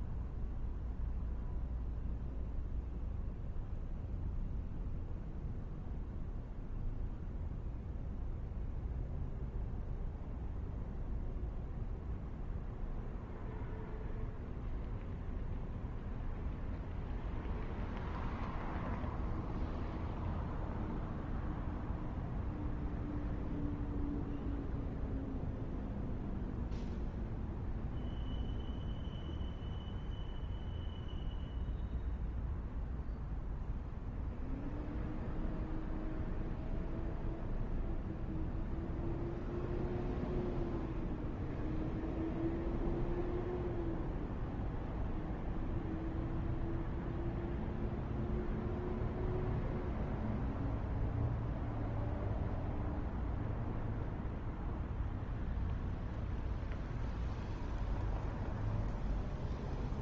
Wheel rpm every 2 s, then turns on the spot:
0, 0, 0, 0, 0, 0, 0, 0, 0, 0, 0, 0, 0, 0, 0, 0, 0, 0, 0, 0, 0, 0, 0, 0, 0, 0, 0, 0, 0, 0.
none